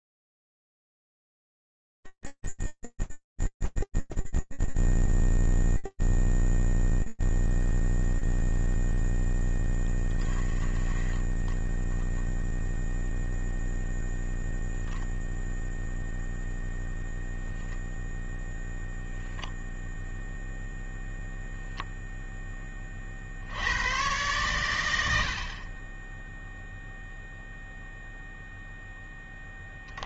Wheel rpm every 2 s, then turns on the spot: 0, 0, 0, 0, 20, 0, 0, 0, 0, 0, 20, 100, 0, 0, 40.
none